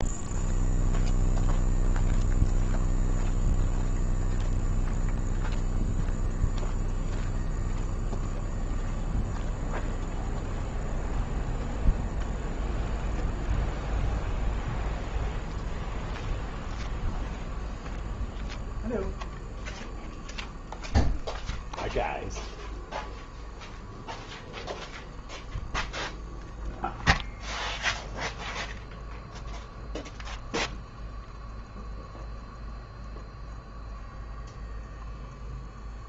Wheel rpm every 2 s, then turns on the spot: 0, 0, 0, 0, 0, 0, 0, 0, 0, 0, 0, 0, 0, 0, 0, 0, 0, 0.
none